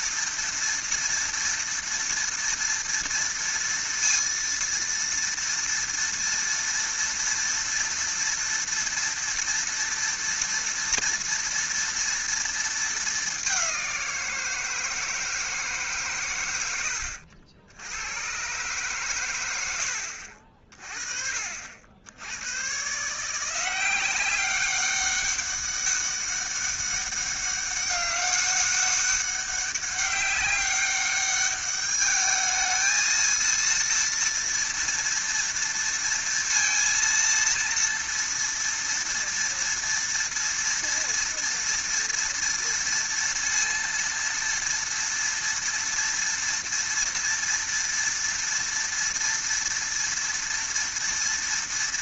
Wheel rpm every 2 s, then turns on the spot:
230, 230, 230, 230, 230, 230, 220, 170, 100, 130, 50, 110, 190, 200, 200, 200, 220, 230, 230, 230, 230, 230, 230, 230, 230, 230.
none